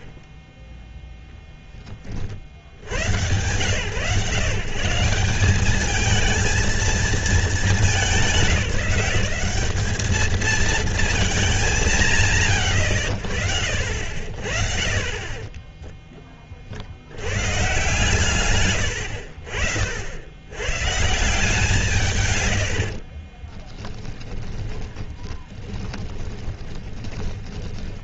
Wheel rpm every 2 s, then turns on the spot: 10, 80, 160, 220, 170, 220, 70, 50, 30, 120, 110, 100, 20, 30.
24-28